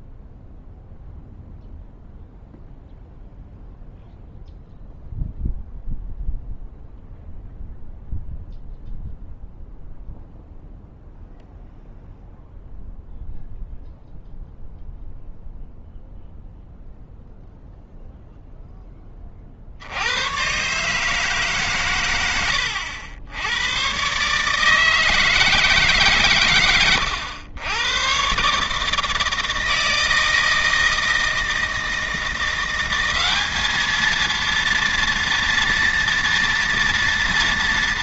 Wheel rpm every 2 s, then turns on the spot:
0, 0, 0, 0, 0, 0, 0, 0, 0, 0, 130, 80, 150, 110, 150, 160, 180, 230, 230.
none